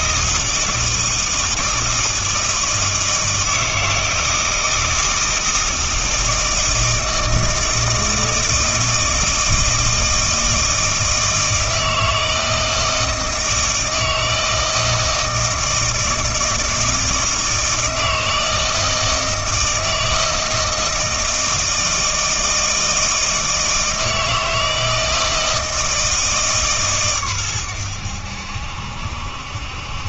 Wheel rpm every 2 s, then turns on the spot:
160, 160, 160, 160, 160, 160, 160, 160, 160, 160, 160, 160, 160, 150, 70.
none